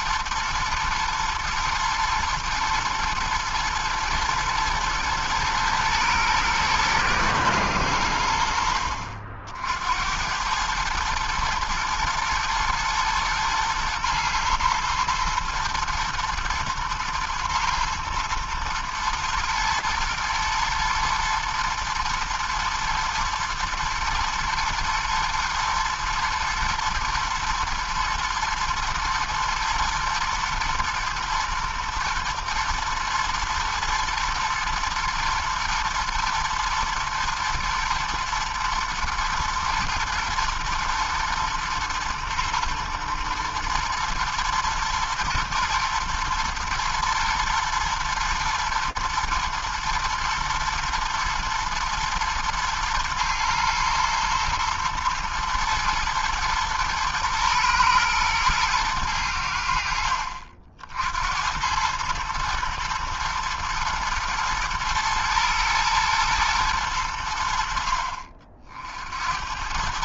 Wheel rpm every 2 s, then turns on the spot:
120, 110, 110, 110, 80, 90, 110, 120, 110, 110, 120, 120, 110, 120, 120, 110, 110, 120, 110, 110, 110, 110, 110, 110, 120, 120, 110, 110, 120, 120, 60, 110, 120, 110, 50.
none